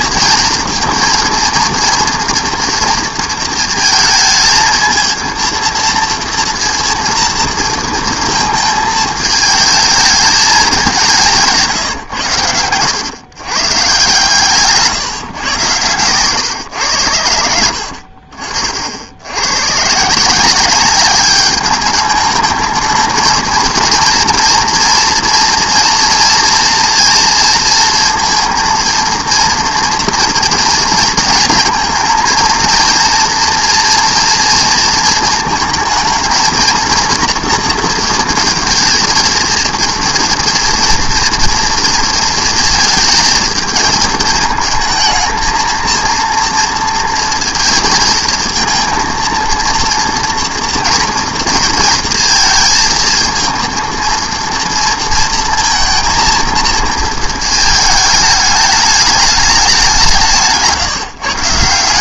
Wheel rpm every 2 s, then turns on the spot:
230, 230, 230, 230, 230, 190, 110, 150, 110, 70, 200, 220, 230, 230, 230, 230, 230, 230, 230, 230, 240, 230, 220, 230, 230, 230, 230, 230, 230, 210, 140.
14-16